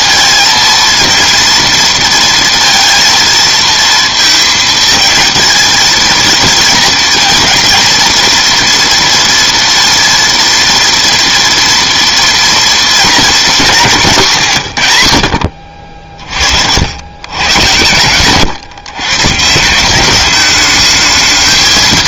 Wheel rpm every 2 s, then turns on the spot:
230, 230, 220, 220, 230, 230, 230, 150, 60, 130, 210.
none